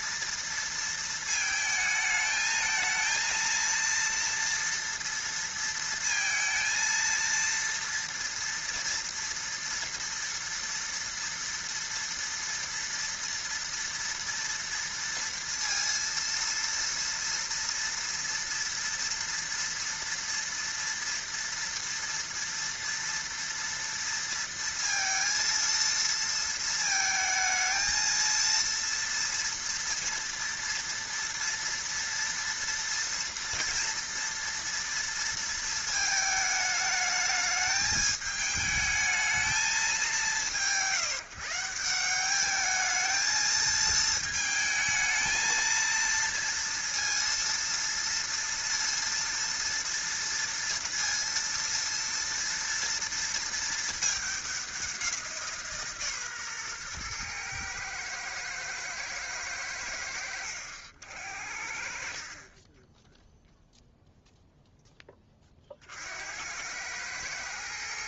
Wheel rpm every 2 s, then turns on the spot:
230, 220, 230, 230, 230, 230, 230, 230, 230, 230, 230, 230, 230, 220, 230, 230, 230, 230, 210, 210, 160, 210, 220, 230, 230, 230, 230, 200, 130, 110, 80, 30, 0, 80.
none